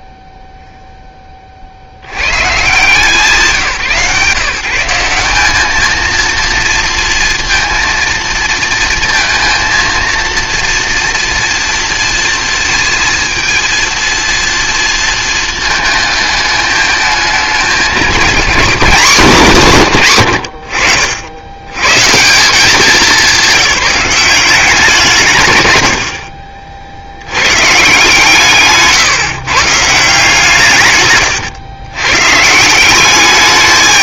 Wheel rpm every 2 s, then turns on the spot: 0, 140, 150, 230, 230, 230, 230, 230, 220, 230, 80, 190, 190, 50, 150, 150, 160.
28-30